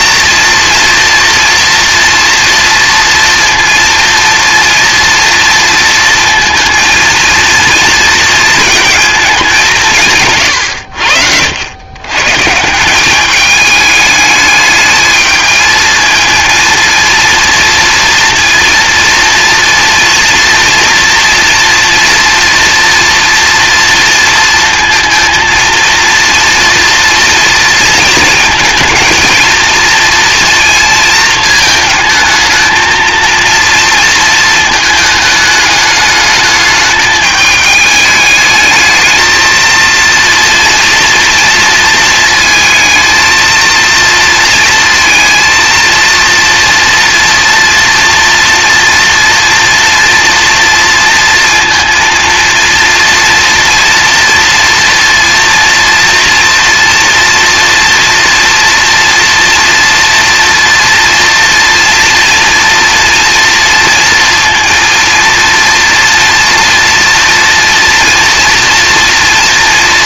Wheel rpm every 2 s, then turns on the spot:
230, 230, 230, 230, 230, 90, 170, 210, 230, 230, 230, 230, 230, 230, 220, 230, 220, 220, 210, 220, 230, 230, 230, 230, 230, 230, 230, 230, 230, 230, 230, 240, 230, 230, 230.
none